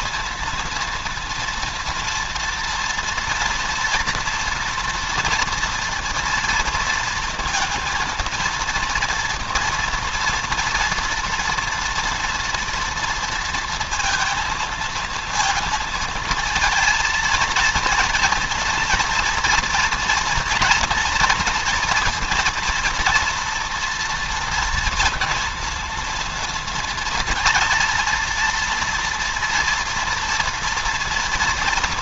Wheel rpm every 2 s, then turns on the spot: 230, 230, 230, 230, 230, 230, 230, 230, 230, 230, 240, 230, 230, 230, 230, 230.
none